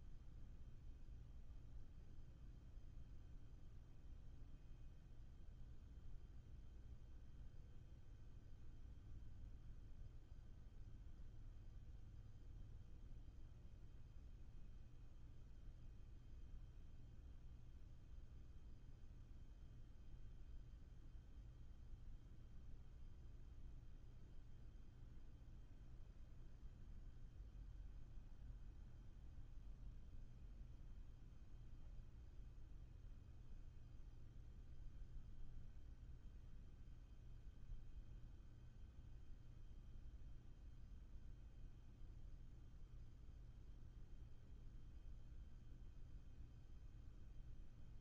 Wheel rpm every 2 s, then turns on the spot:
0, 0, 0, 0, 0, 0, 0, 0, 0, 0, 0, 0, 0, 0, 0, 0, 0, 0, 0, 0, 0, 0, 0, 0.
none